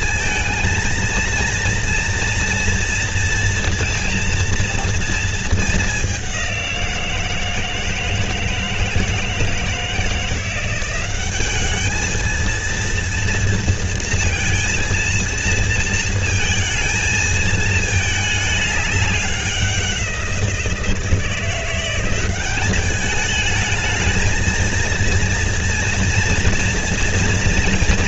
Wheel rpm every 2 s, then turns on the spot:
220, 230, 230, 190, 160, 170, 230, 230, 230, 210, 170, 190, 220, 230.
none